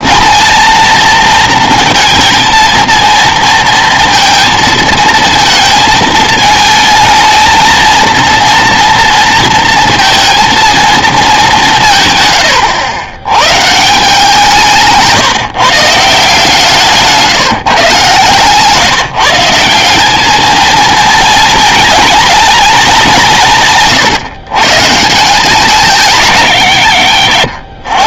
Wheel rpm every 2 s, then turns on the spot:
220, 230, 230, 220, 230, 230, 100, 160, 160, 160, 220, 220, 140, 130.
none